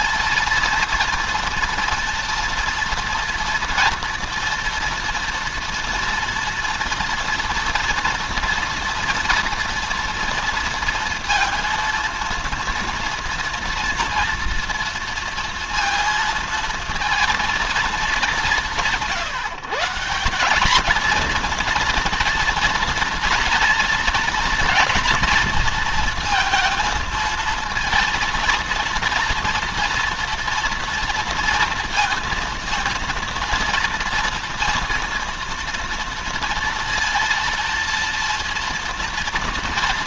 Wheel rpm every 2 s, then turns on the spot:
230, 230, 240, 230, 230, 230, 230, 230, 230, 190, 200, 230, 220, 230, 230, 230, 230, 230, 230, 230.
none